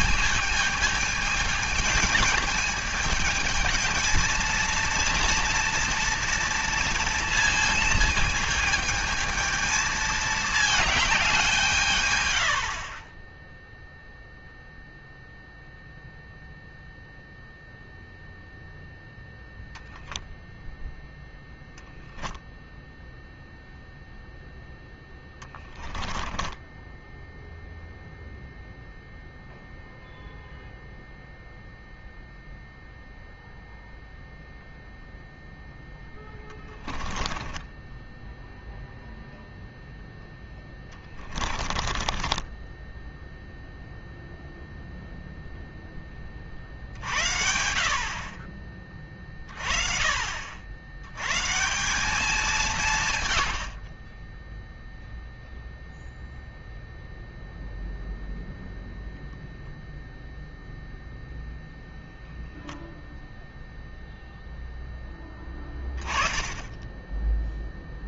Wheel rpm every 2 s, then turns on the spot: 210, 220, 230, 230, 220, 210, 60, 0, 0, 0, 0, 0, 10, 10, 0, 0, 0, 0, 20, 0, 10, 10, 0, 60, 30, 80, 170, 0, 0, 0, 0, 0, 0, 10.
24-28 36-38 40-44